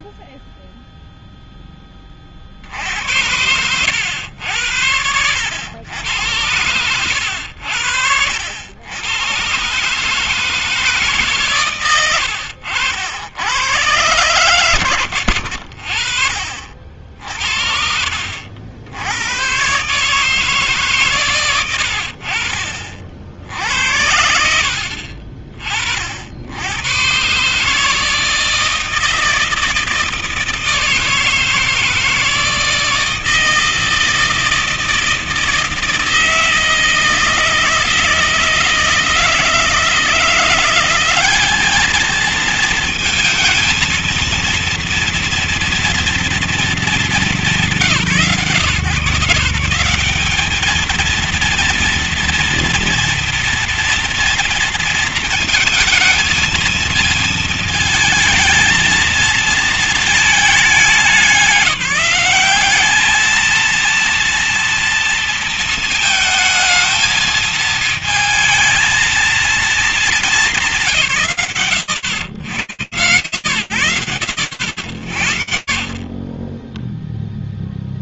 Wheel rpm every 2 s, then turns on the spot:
0, 50, 80, 100, 80, 160, 90, 120, 50, 80, 150, 70, 70, 80, 160, 160, 160, 160, 160, 160, 180, 230, 230, 230, 150, 210, 230, 230, 220, 220, 210, 200, 230, 220, 230, 170, 100, 60, 0.
12-14